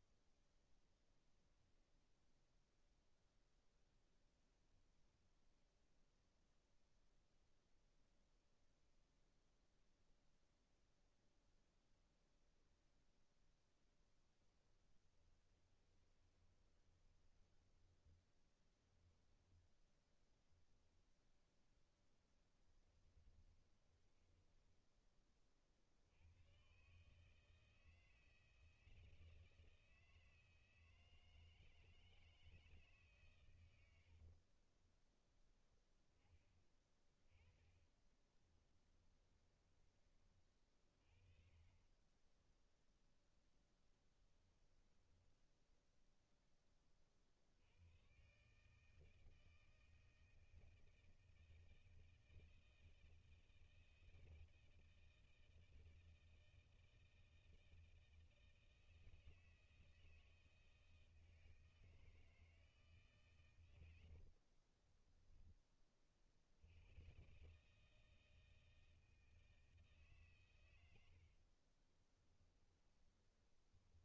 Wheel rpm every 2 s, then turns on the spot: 10, 0, 0, 0, 0, 0, 0, 20, 20, 10, 0, 10, 10, 110, 160, 160, 160, 20, 20, 20, 30, 10, 10, 20, 140, 160, 160, 160, 160, 160, 160, 160, 40, 90, 160, 110, 20.
14-20 22-26 34-40 42-46 64-66 72-74